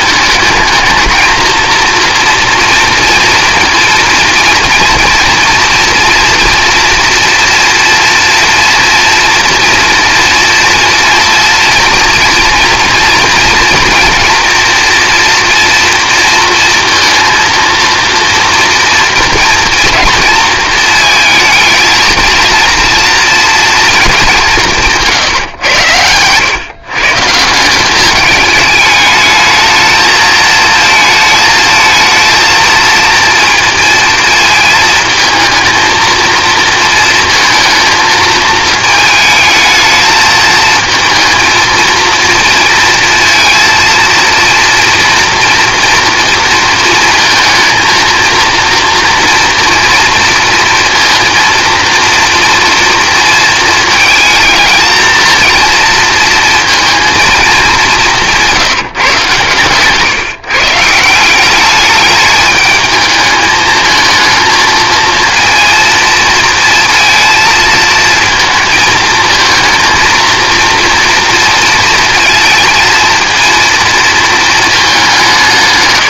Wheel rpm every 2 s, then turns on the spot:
220, 230, 240, 230, 230, 230, 240, 230, 230, 230, 230, 230, 150, 140, 210, 220, 230, 220, 230, 220, 220, 230, 240, 230, 230, 230, 230, 220, 230, 150, 150, 220, 230, 230, 230, 230, 230, 200.
none